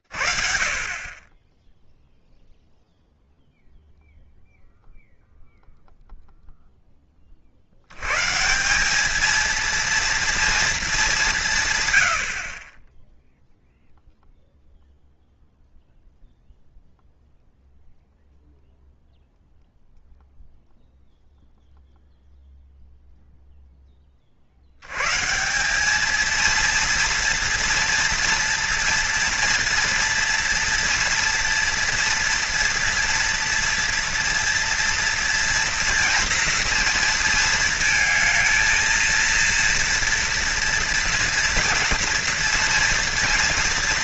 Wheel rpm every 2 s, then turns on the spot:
30, 0, 0, 10, 180, 220, 30, 0, 0, 0, 0, 0, 140, 230, 230, 230, 240, 230, 230, 230, 240, 230.
none